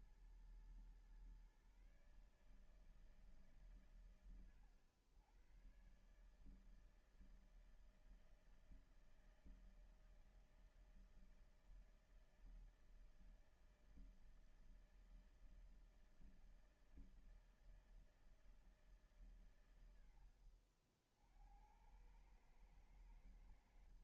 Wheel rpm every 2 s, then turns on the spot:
120, 150, 120, 140, 160, 160, 160, 160, 160, 160, 80, 100.
20-22